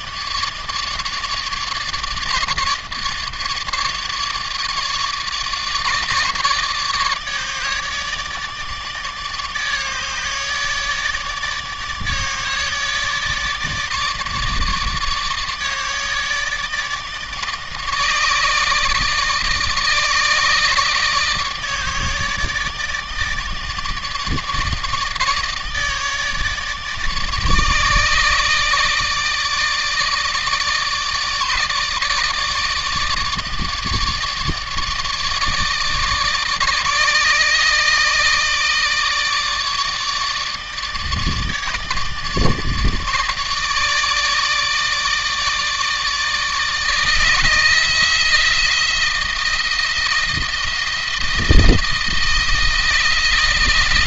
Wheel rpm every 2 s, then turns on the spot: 150, 150, 150, 150, 150, 150, 150, 150, 150, 150, 150, 150, 150, 150, 150, 150, 150, 150, 150, 160, 150, 150, 150, 160, 160, 160, 160.
none